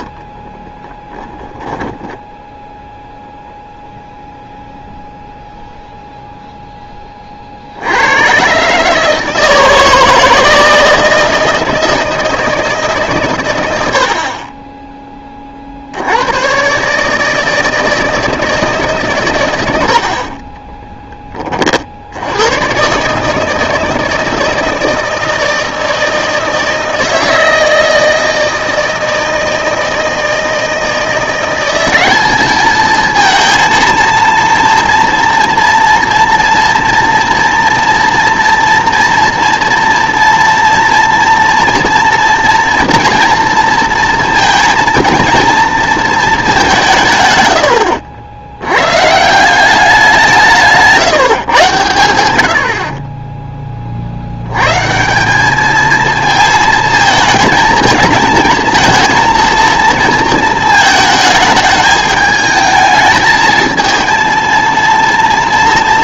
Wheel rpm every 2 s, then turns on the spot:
20, 0, 0, 0, 140, 160, 160, 30, 120, 160, 20, 110, 160, 160, 160, 170, 220, 230, 240, 230, 230, 230, 230, 200, 100, 160, 70, 110, 220, 220, 220, 220, 230.
0-2 20-22